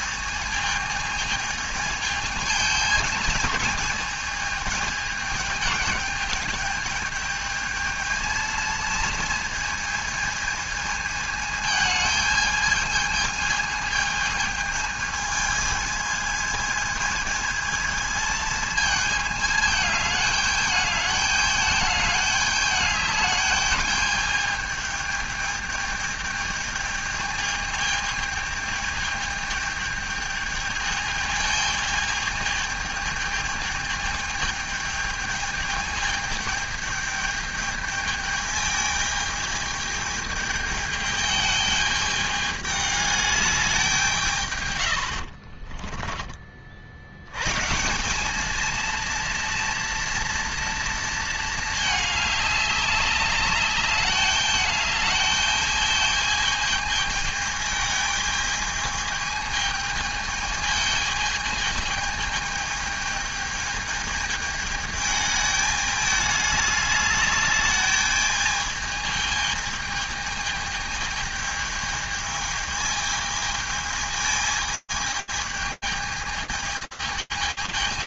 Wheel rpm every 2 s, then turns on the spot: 220, 220, 210, 210, 220, 220, 220, 220, 220, 220, 210, 210, 210, 210, 220, 210, 220, 220, 210, 210, 210, 210, 70, 90, 230, 220, 200, 210, 220, 220, 220, 220, 210, 210, 220, 220, 220, 220, 210.
44-46